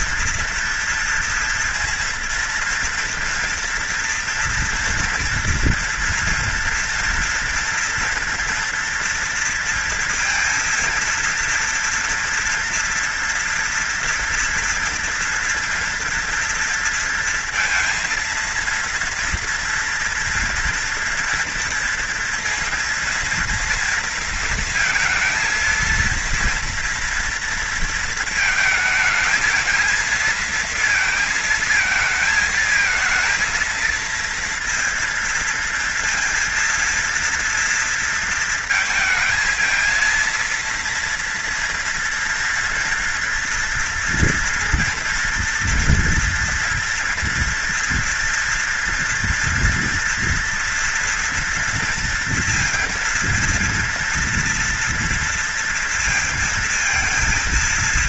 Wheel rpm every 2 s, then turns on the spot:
230, 230, 230, 230, 240, 230, 230, 230, 230, 230, 230, 230, 220, 230, 220, 230, 220, 230, 230, 230, 230, 230, 230, 230, 230, 230, 230, 230, 230.
none